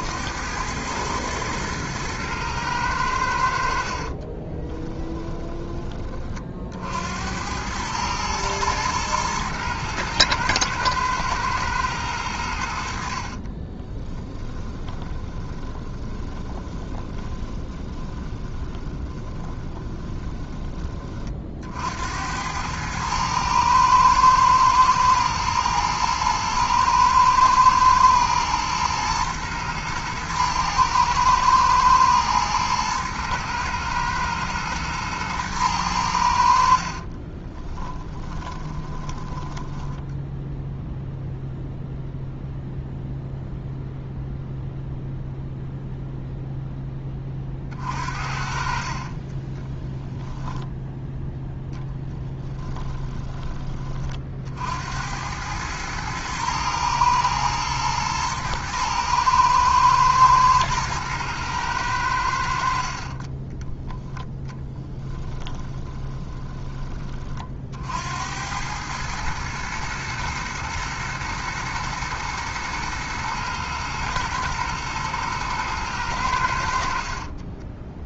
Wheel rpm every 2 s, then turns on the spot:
110, 90, 10, 70, 110, 110, 70, 20, 20, 20, 30, 110, 110, 110, 120, 110, 110, 120, 40, 20, 0, 0, 0, 10, 40, 0, 10, 80, 110, 110, 110, 40, 10, 20, 110, 110, 110, 120, 50.
4-6 12-20 36-40 52-54 64-66